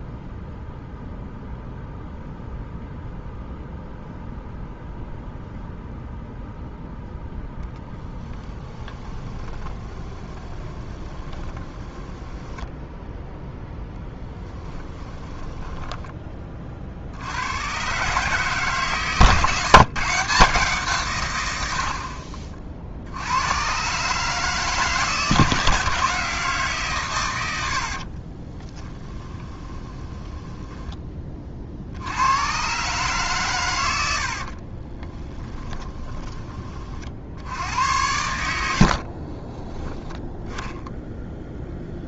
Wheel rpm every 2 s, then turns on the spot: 0, 0, 0, 0, 10, 20, 0, 10, 50, 140, 150, 50, 150, 130, 10, 10, 130, 30, 50, 60, 10.
8-12 14-16 28-30 34-36 38-42